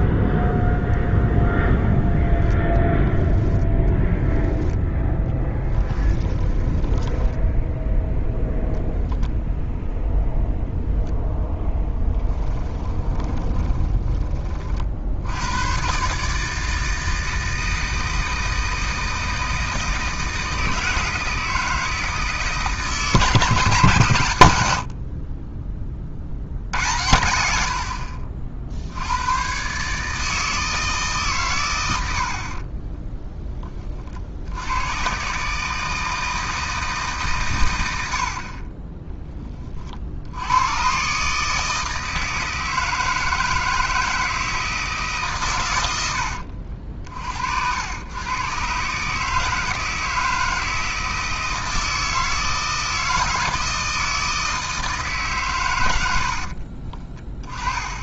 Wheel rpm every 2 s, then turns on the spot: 10, 10, 0, 10, 0, 0, 20, 50, 160, 160, 160, 150, 70, 100, 70, 160, 30, 90, 160, 20, 120, 160, 160, 60, 140, 160, 160, 160, 50.
6-8 12-14 32-34 38-40 56-58